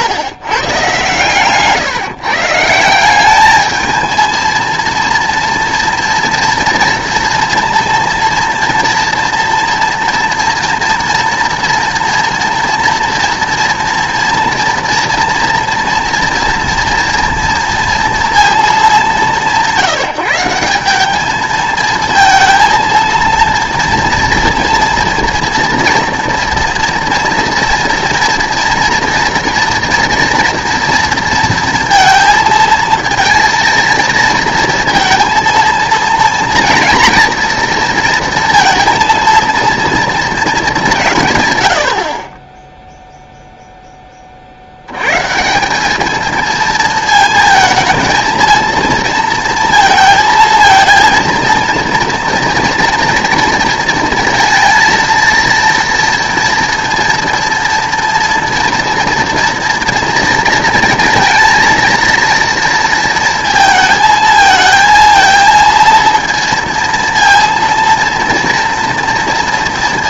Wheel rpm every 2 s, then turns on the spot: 130, 160, 230, 230, 230, 230, 230, 230, 230, 220, 180, 230, 230, 230, 230, 230, 230, 230, 230, 230, 210, 10, 70, 220, 220, 230, 240, 230, 230, 230, 230, 230, 220, 230, 230.
none